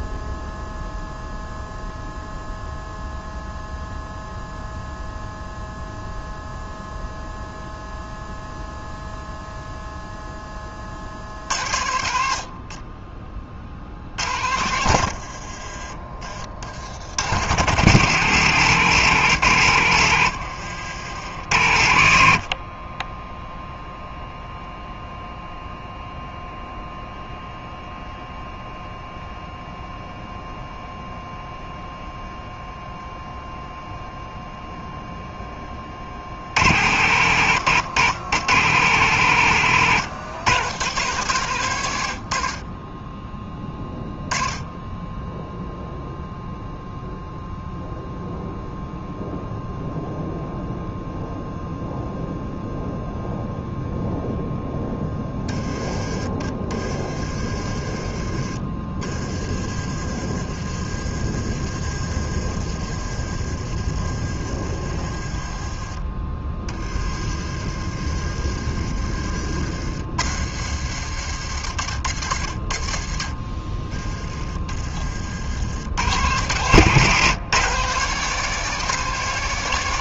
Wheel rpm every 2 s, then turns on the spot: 0, 0, 0, 0, 0, 30, 30, 70, 80, 140, 70, 20, 0, 0, 0, 0, 0, 0, 90, 120, 100, 20, 10, 0, 0, 0, 0, 10, 30, 20, 40, 30, 40, 20, 30, 70, 30, 40, 130, 160.
14-16 22-24 56-58 60-66 74-76